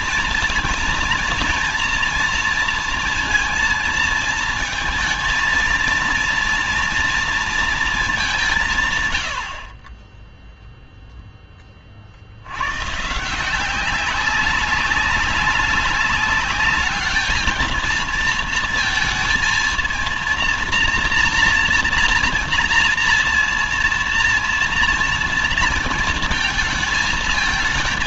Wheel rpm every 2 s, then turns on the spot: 230, 230, 220, 230, 150, 0, 110, 190, 200, 230, 230, 230, 230, 220.
none